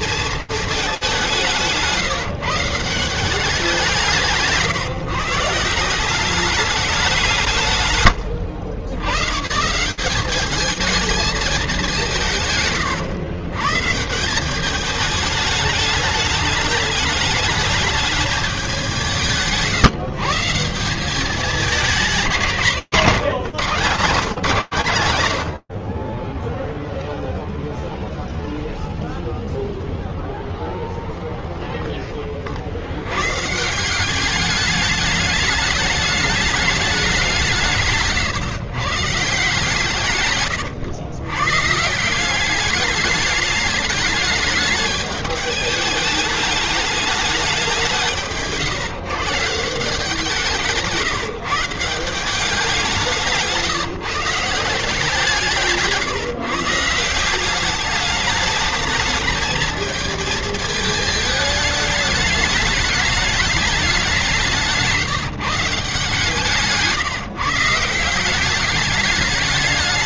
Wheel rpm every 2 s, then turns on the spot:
220, 160, 160, 190, 100, 200, 150, 180, 210, 200, 170, 170, 130, 0, 0, 0, 150, 210, 170, 150, 150, 210, 210, 180, 170, 160, 170, 150, 200, 220, 220, 200, 160, 170, 210.
12-14 22-24